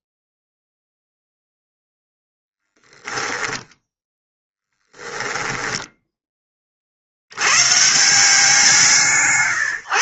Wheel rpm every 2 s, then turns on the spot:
0, 10, 10, 90, 80.
2-6